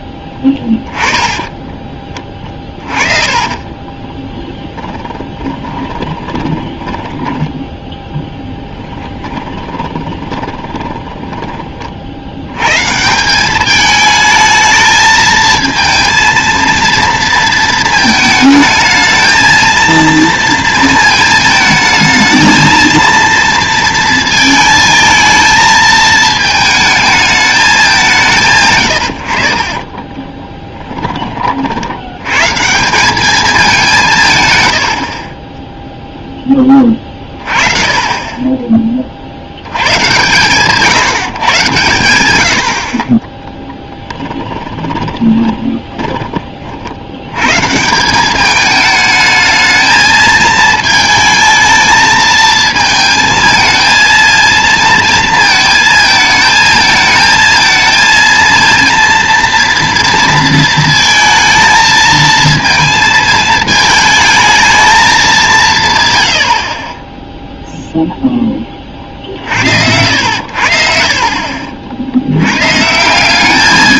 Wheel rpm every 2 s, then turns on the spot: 10, 30, 10, 20, 10, 20, 140, 220, 230, 220, 230, 230, 220, 220, 100, 10, 160, 100, 20, 30, 140, 60, 20, 50, 210, 220, 220, 230, 220, 230, 230, 230, 220, 30, 20, 70, 140.
0-12 44-46 70-72